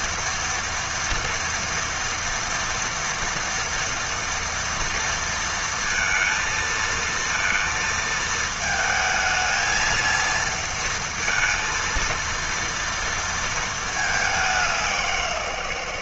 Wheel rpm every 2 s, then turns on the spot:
230, 230, 230, 230, 220, 230, 230, 190.
none